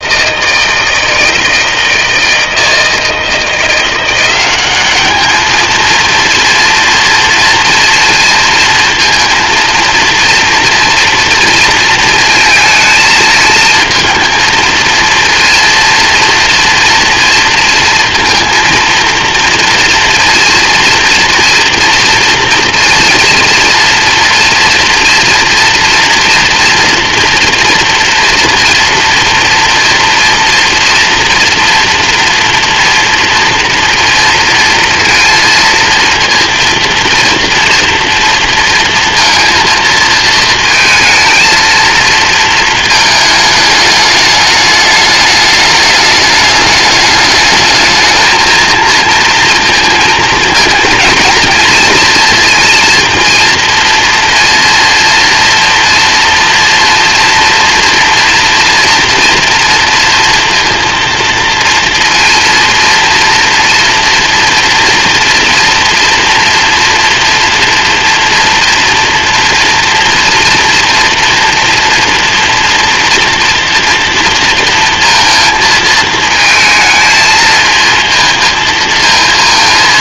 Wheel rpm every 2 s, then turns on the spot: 160, 160, 210, 230, 230, 230, 220, 230, 240, 230, 240, 230, 230, 240, 230, 240, 230, 230, 230, 230, 220, 220, 210, 210, 230, 230, 230, 230, 230, 230, 230, 230, 230, 230, 230, 230, 240, 230, 220, 230.
none